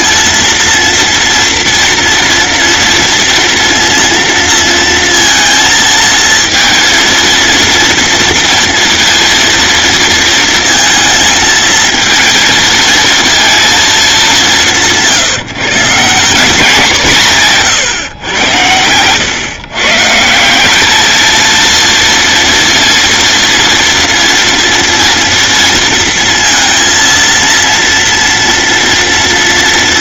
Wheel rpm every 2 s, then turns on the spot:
230, 230, 230, 230, 230, 230, 230, 170, 180, 100, 200, 230, 230, 230, 230.
18-20